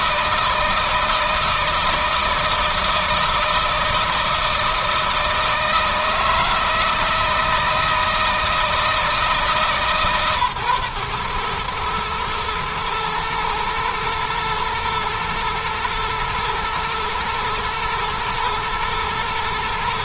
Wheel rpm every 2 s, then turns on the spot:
160, 160, 160, 160, 160, 120, 110, 110, 120, 110.
none